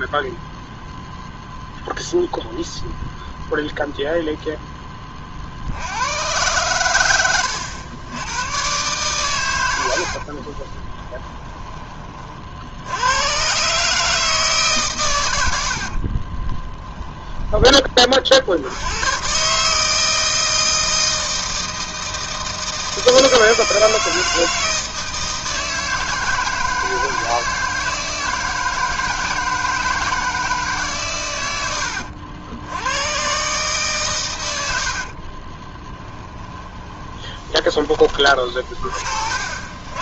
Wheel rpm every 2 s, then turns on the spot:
0, 0, 20, 110, 120, 20, 90, 140, 20, 80, 160, 160, 160, 160, 160, 130, 100, 60, 20, 40.
10-12 16-18 34-38